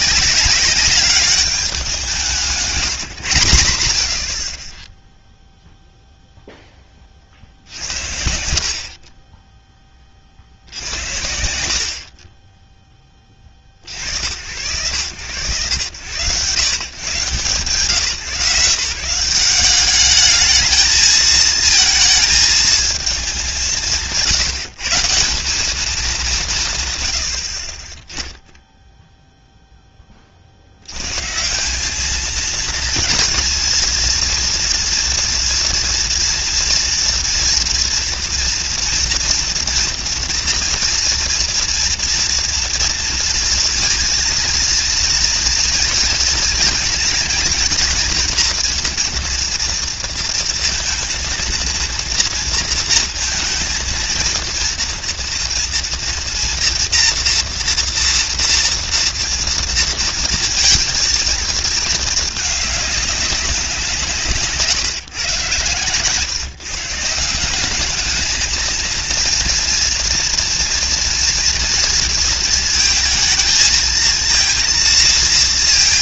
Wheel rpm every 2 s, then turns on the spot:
190, 170, 40, 0, 70, 40, 20, 90, 110, 130, 210, 220, 140, 190, 10, 50, 220, 230, 230, 230, 230, 230, 230, 230, 240, 230, 230, 230, 240, 230, 230, 210, 160, 150, 220, 230, 230, 230.
none